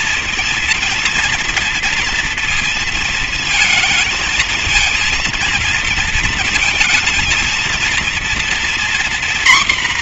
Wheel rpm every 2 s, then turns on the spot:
230, 230, 220, 230, 240.
none